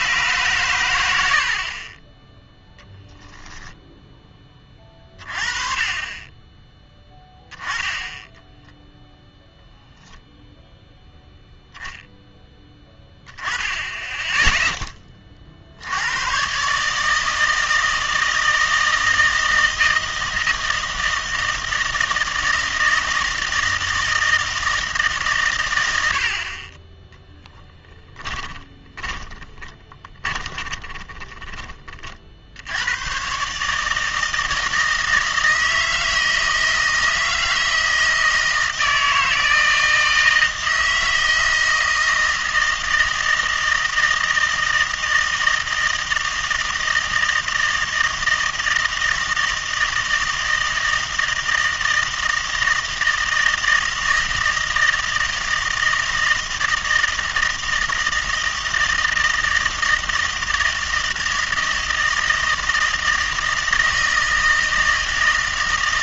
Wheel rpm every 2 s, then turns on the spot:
120, 0, 20, 20, 10, 0, 10, 10, 130, 160, 160, 160, 160, 40, 20, 20, 70, 160, 160, 160, 160, 160, 160, 160, 160, 160, 160, 160, 160, 160, 160, 160, 160.
28-32